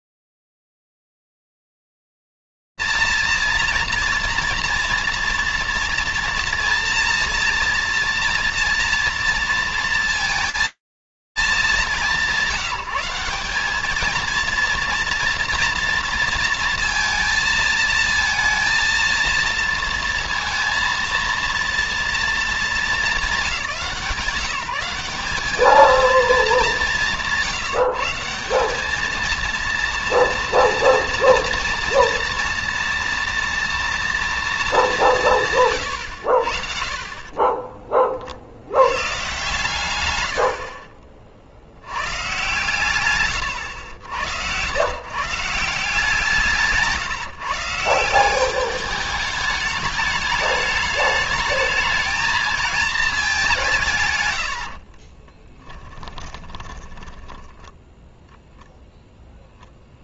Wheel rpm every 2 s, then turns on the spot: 90, 220, 230, 230, 230, 230, 170, 230, 230, 230, 230, 210, 180, 210, 210, 230, 230, 190, 30, 130, 60, 110, 170, 150, 210, 220, 180, 20, 10, 0.
54-58